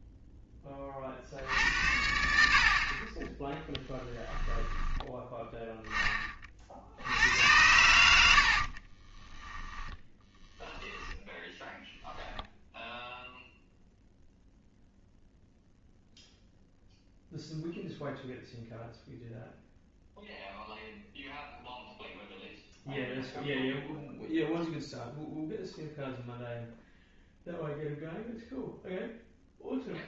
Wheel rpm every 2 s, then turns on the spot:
30, 50, 10, 60, 30, 10, 10, 0, 0, 0, 0, 0, 0, 0, 0.
8-12